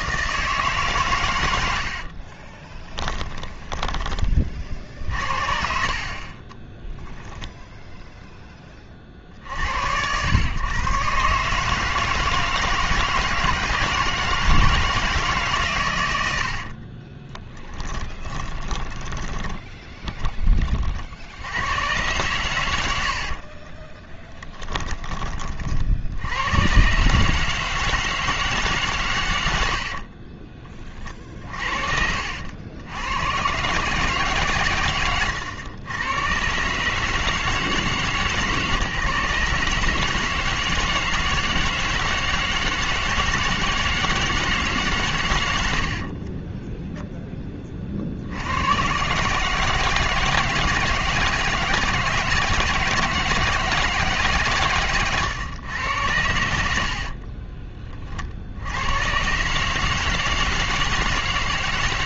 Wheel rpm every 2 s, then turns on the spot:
150, 30, 40, 20, 20, 120, 160, 160, 60, 20, 30, 110, 20, 110, 150, 30, 80, 130, 140, 140, 160, 160, 150, 20, 100, 160, 160, 140, 70, 70, 160.
2-4 16-20 24-26 46-48